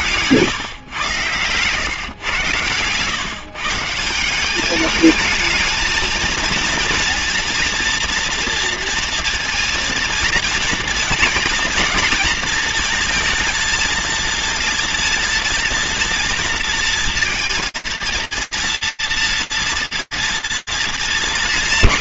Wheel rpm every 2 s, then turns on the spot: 130, 120, 210, 230, 230, 230, 230, 230, 230, 230, 210.
none